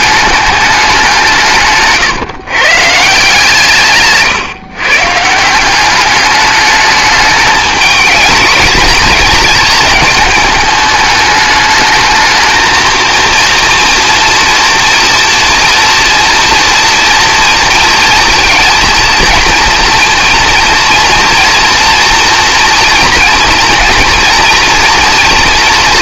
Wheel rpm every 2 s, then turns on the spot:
210, 140, 140, 210, 220, 210, 220, 230, 230, 230, 230, 240, 230.
none